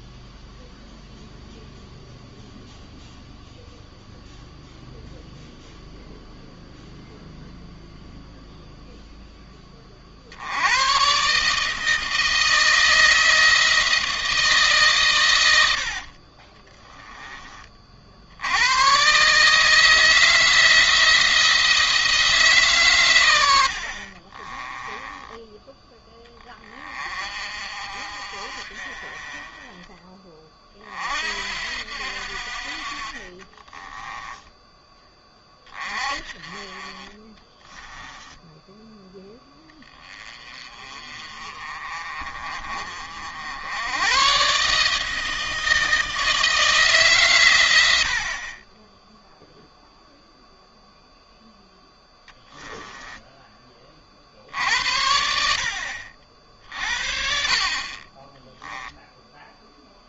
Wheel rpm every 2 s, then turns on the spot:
0, 0, 0, 0, 0, 110, 160, 130, 30, 120, 160, 130, 10, 30, 40, 50, 40, 20, 30, 10, 30, 50, 150, 140, 10, 0, 10, 60, 60, 10.
24-26 32-34 52-54